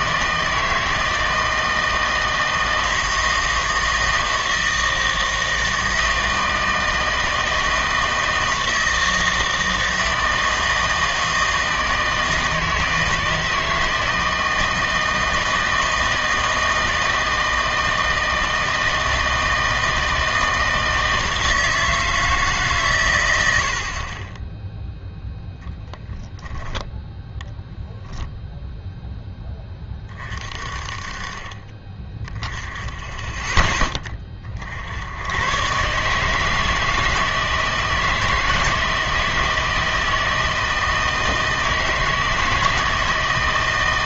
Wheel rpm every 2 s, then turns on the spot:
160, 160, 160, 160, 160, 160, 160, 160, 160, 160, 160, 140, 0, 10, 0, 30, 10, 60, 160, 160, 160, 160.
26-28